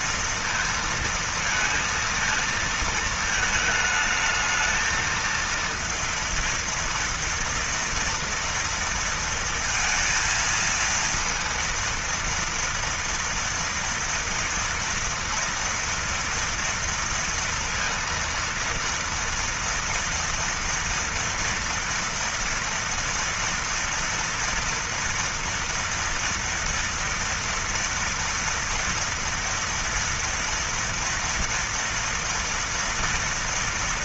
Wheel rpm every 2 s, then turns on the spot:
230, 230, 220, 230, 230, 230, 230, 230, 230, 230, 230, 230, 230, 230, 240, 230, 230.
none